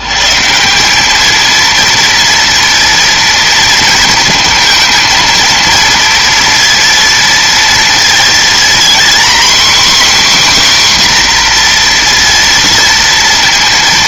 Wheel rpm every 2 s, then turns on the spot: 110, 230, 230, 230, 230, 270, 240.
none